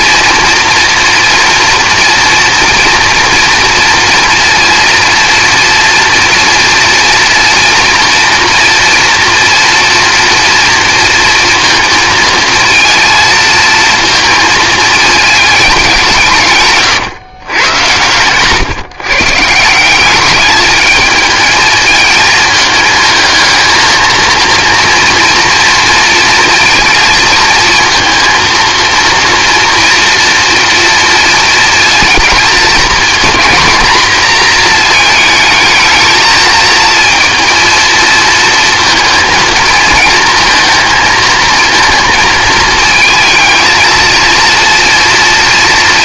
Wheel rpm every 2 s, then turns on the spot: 230, 240, 240, 230, 230, 230, 230, 220, 140, 140, 210, 220, 230, 230, 230, 230, 230, 230, 220, 230, 220, 220, 230.
16-18